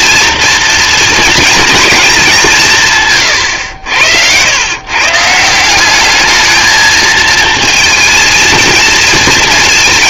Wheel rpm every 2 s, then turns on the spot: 230, 160, 120, 220, 230.
none